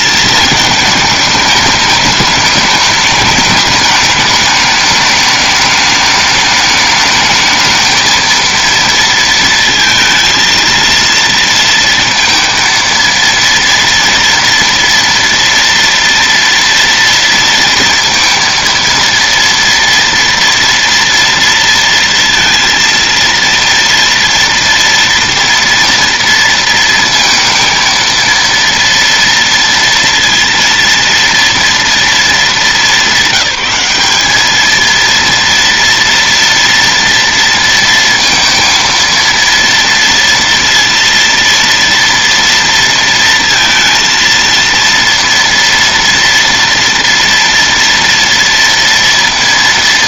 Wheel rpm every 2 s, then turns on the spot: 220, 210, 210, 210, 230, 230, 230, 230, 230, 230, 240, 230, 230, 230, 230, 230, 220, 210, 230, 230, 230, 230, 230, 230, 230.
none